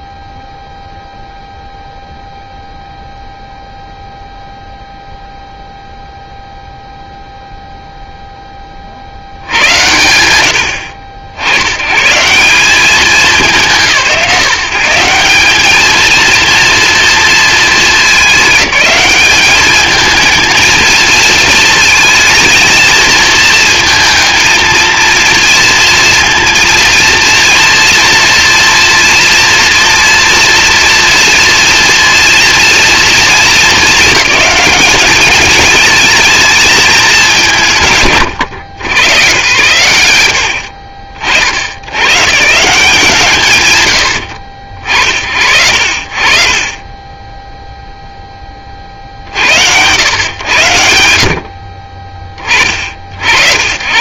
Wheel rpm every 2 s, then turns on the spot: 0, 0, 0, 0, 50, 90, 190, 170, 230, 200, 230, 220, 230, 230, 230, 230, 240, 210, 220, 100, 90, 160, 70, 30, 40, 90, 50.
none